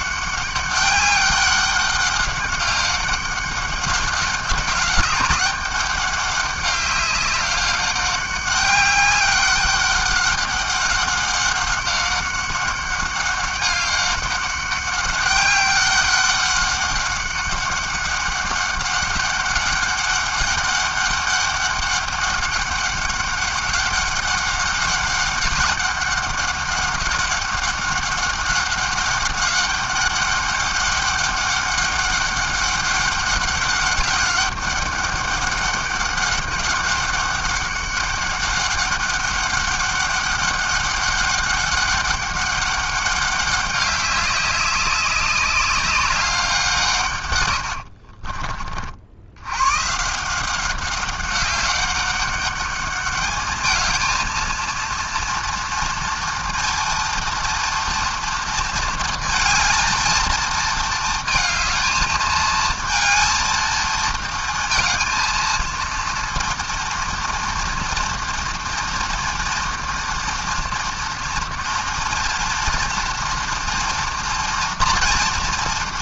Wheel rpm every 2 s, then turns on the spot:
190, 200, 190, 200, 190, 190, 190, 200, 200, 200, 200, 200, 190, 200, 200, 200, 200, 200, 200, 200, 200, 200, 200, 160, 30, 180, 200, 230, 230, 230, 230, 220, 230, 230, 230, 240, 230, 240.
none